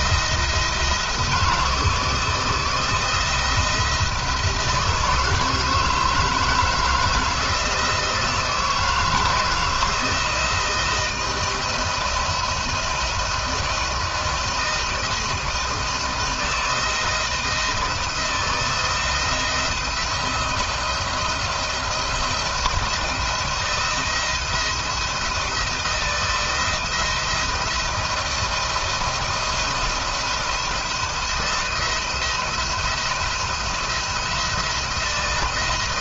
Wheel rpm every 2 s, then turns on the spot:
170, 170, 160, 160, 160, 160, 160, 160, 160, 170, 160, 170, 170, 160, 170, 160, 170, 170.
none